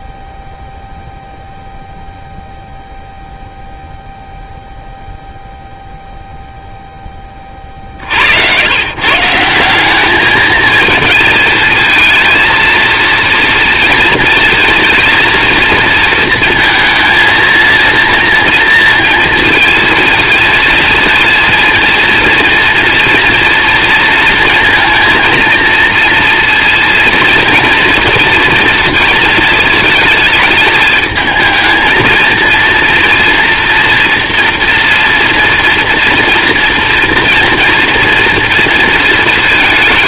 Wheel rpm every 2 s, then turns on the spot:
0, 0, 0, 40, 190, 220, 230, 230, 230, 230, 230, 230, 230, 230, 220, 220, 230, 230, 240, 220.
none